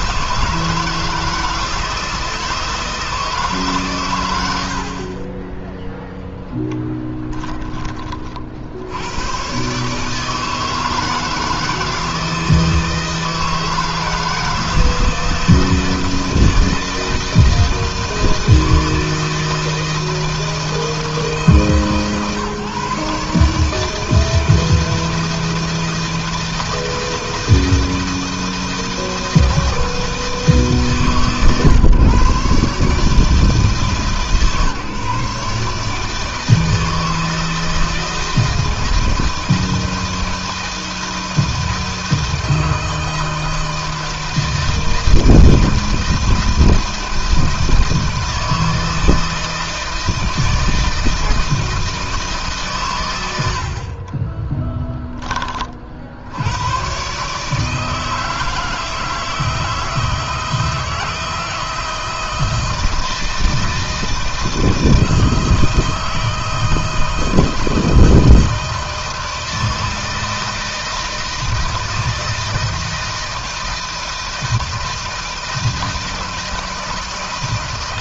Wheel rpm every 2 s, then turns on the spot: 160, 160, 50, 10, 90, 160, 160, 160, 160, 160, 160, 140, 160, 160, 160, 140, 140, 150, 160, 160, 170, 160, 160, 160, 160, 160, 110, 10, 120, 160, 160, 160, 160, 160, 160, 160, 160, 160, 160.
6-8